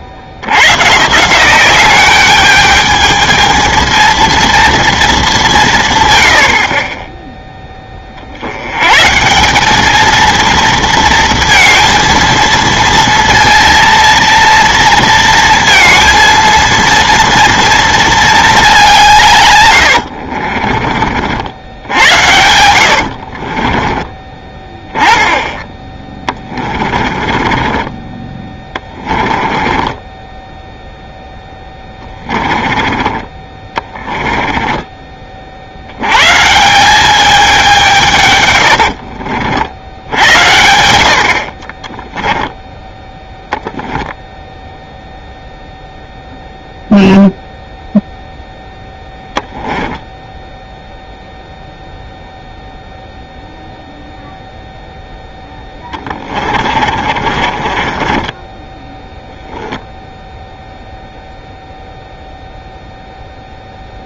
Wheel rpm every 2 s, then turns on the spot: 140, 220, 220, 30, 120, 230, 230, 230, 230, 180, 50, 80, 20, 30, 20, 0, 20, 20, 190, 80, 80, 10, 0, 0, 0, 0, 0, 0, 40, 10, 0, 0.
22-24 26-30 32-34 38-40 56-60